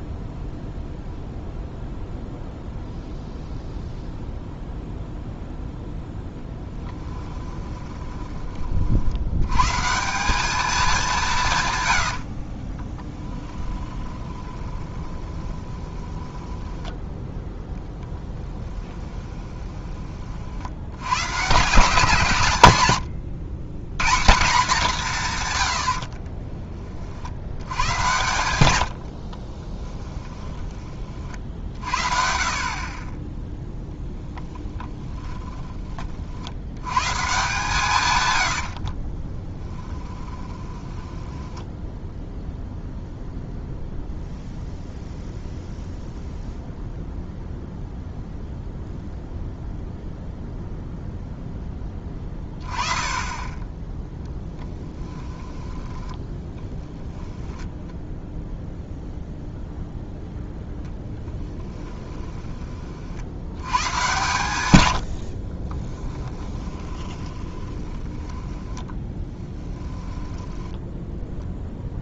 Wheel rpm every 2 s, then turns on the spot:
0, 0, 0, 10, 40, 210, 30, 20, 10, 10, 60, 130, 180, 30, 80, 20, 40, 10, 90, 60, 10, 0, 0, 0, 0, 0, 10, 10, 10, 0, 0, 30, 120, 20, 10, 10.
12-16 18-20 28-30 34-36 38-42 54-58 66-72